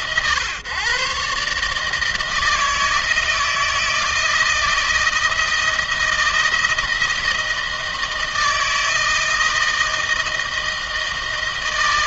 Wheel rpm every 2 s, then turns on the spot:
120, 160, 160, 160, 160, 160.
none